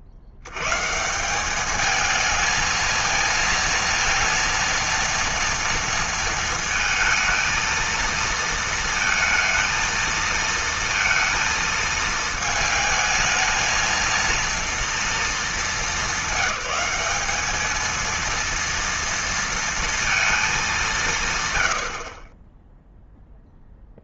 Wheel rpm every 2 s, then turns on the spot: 110, 220, 230, 220, 230, 230, 220, 230, 200, 230, 200, 10.
none